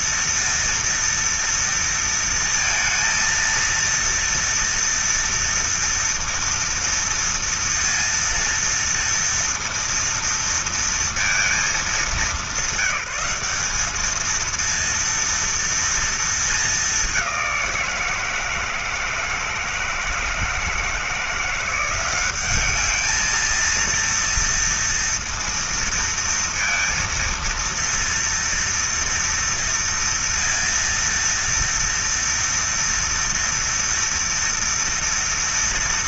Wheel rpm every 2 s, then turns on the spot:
230, 230, 230, 230, 230, 230, 190, 230, 210, 160, 170, 210, 230, 230, 230, 230, 230, 240.
none